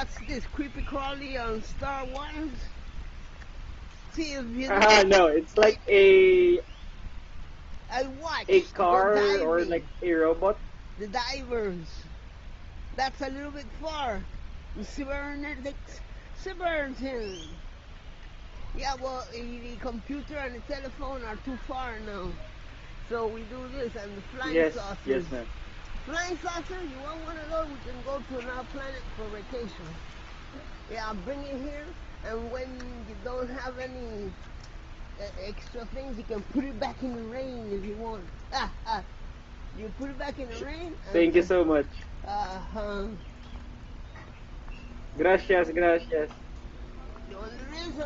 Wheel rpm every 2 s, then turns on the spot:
0, 0, 0, 0, 0, 0, 0, 0, 0, 0, 0, 0, 0, 0, 0, 0, 0, 0, 0, 0, 0, 0, 0, 0.
none